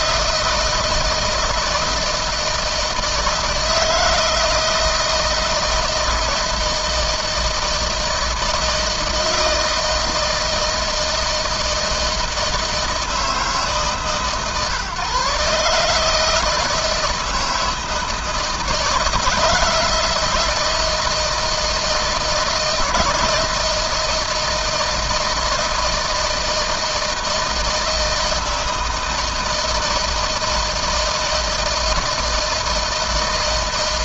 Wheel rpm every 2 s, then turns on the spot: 160, 160, 160, 160, 160, 160, 160, 140, 160, 170, 160, 160, 160, 160, 160, 160, 160.
none